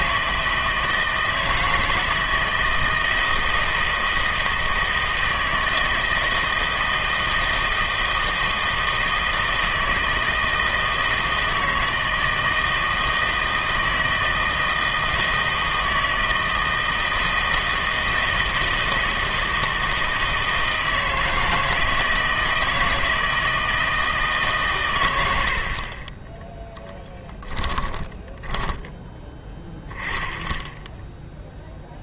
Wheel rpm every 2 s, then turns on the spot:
160, 160, 160, 160, 160, 160, 160, 160, 160, 160, 160, 160, 140, 10, 20, 0.
28-30